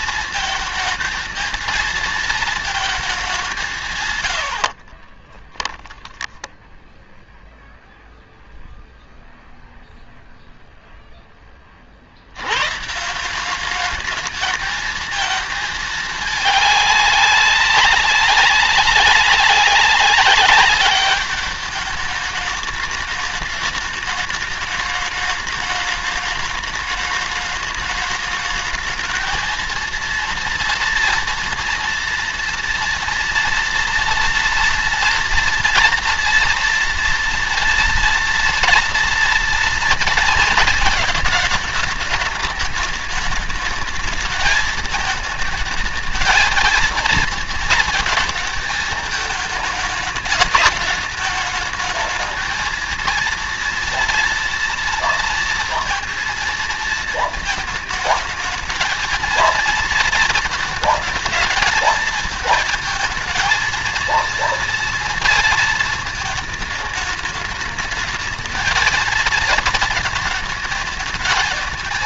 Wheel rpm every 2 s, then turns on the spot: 220, 220, 70, 10, 0, 0, 140, 220, 200, 200, 200, 210, 210, 210, 220, 230, 230, 230, 230, 230, 230, 210, 220, 220, 220, 210, 220, 230, 230, 220, 220, 220, 230, 220, 220, 220.
4-6